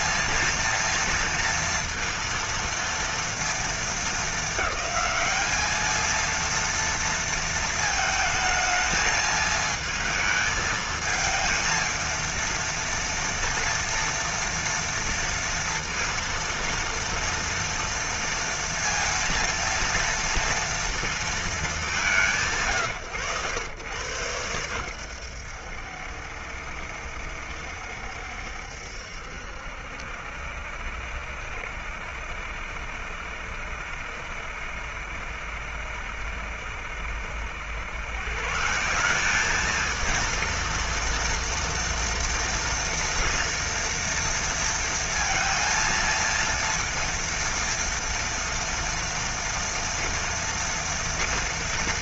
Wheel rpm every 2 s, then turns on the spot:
230, 230, 210, 230, 220, 220, 230, 230, 230, 230, 230, 100, 100, 70, 70, 70, 70, 70, 70, 190, 230, 230, 230, 230, 230, 230.
none